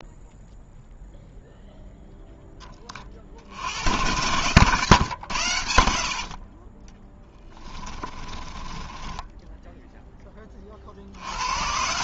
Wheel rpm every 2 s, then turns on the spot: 0, 20, 110, 40, 20, 30.
8-10